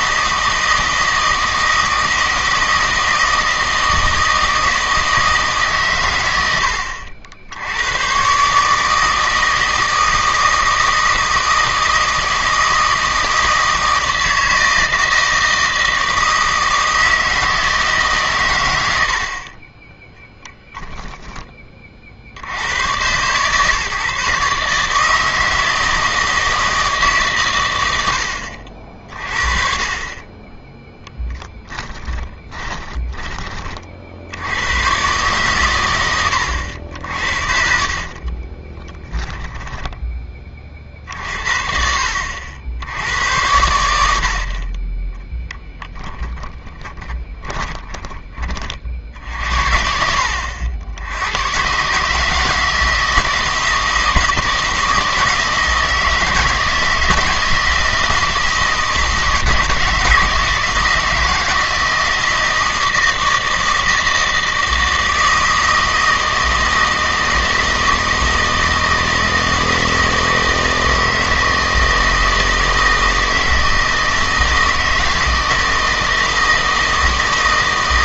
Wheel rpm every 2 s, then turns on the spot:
160, 160, 160, 80, 150, 160, 160, 160, 160, 100, 10, 100, 150, 160, 60, 10, 20, 110, 70, 30, 50, 80, 30, 20, 40, 80, 160, 160, 160, 160, 160, 160, 160, 160, 160, 160, 160, 160, 160.
20-22 32-34 38-40 46-48